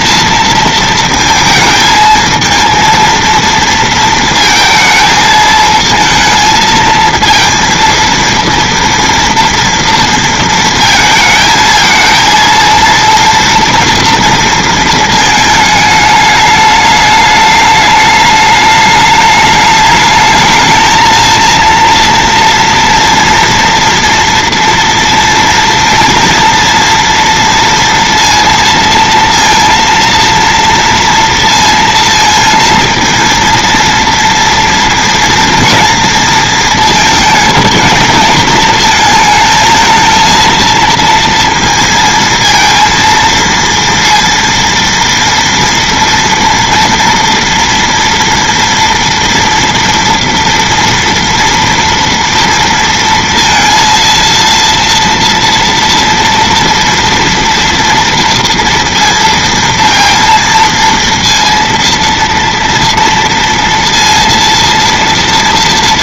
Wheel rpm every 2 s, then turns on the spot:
230, 220, 230, 220, 230, 220, 230, 220, 210, 210, 220, 230, 230, 230, 230, 230, 230, 230, 230, 220, 230, 230, 230, 230, 230, 230, 230, 230, 230, 230, 230, 230, 230.
none